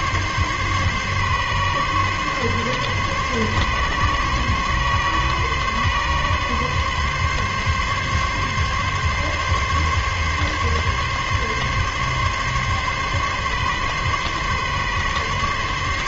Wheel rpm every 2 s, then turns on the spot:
140, 140, 140, 140, 140, 140, 140, 140.
none